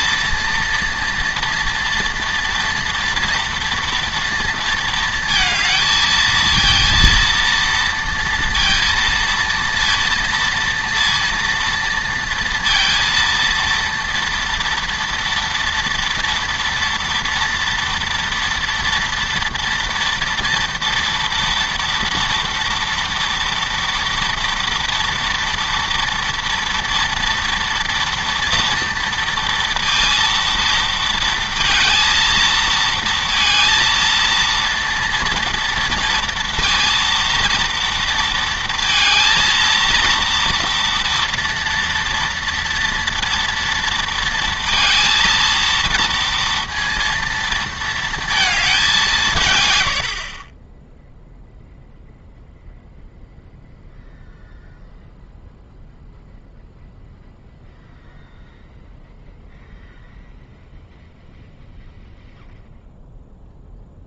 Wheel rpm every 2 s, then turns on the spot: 230, 230, 230, 230, 230, 230, 230, 230, 230, 230, 230, 230, 230, 230, 240, 230, 230, 230, 230, 230, 230, 230, 230, 230, 210, 20, 0, 0, 0, 0, 0, 0.
50-52